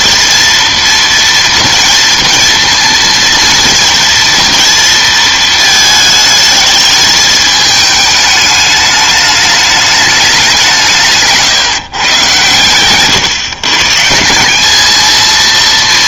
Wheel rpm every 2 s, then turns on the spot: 230, 230, 230, 220, 210, 190, 120, 200.
none